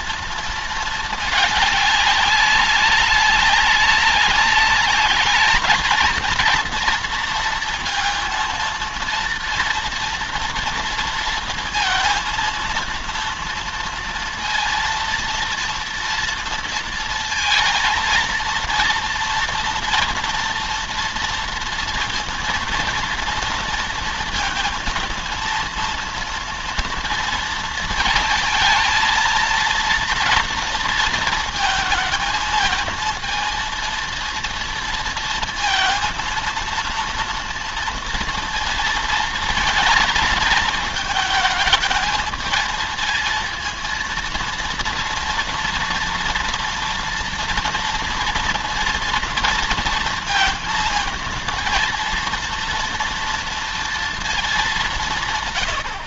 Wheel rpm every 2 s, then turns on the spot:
220, 200, 200, 230, 230, 230, 230, 230, 230, 230, 230, 230, 230, 230, 220, 230, 220, 230, 230, 230, 220, 220, 230, 230, 230, 230, 230, 200.
none